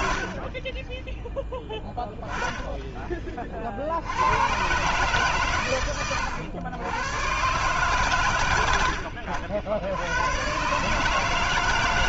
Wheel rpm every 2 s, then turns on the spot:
10, 30, 130, 120, 80, 160.
none